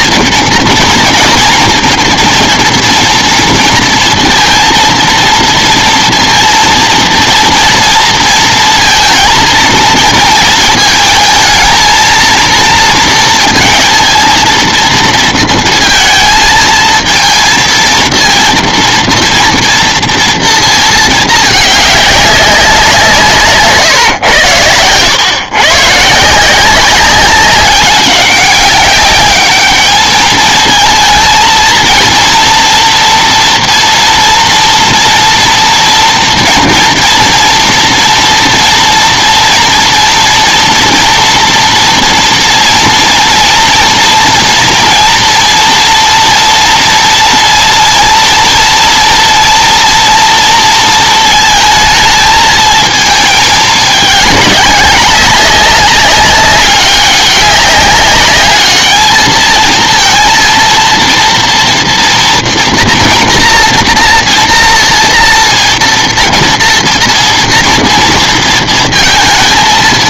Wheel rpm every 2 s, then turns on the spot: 230, 230, 230, 230, 230, 220, 230, 230, 220, 230, 230, 190, 100, 180, 200, 220, 230, 230, 230, 230, 230, 230, 230, 230, 230, 230, 220, 200, 200, 210, 230, 230, 230, 230, 230.
none